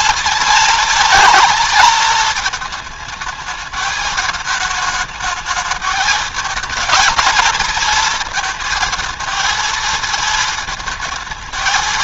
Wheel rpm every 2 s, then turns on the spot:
220, 220, 220, 220, 230, 220.
none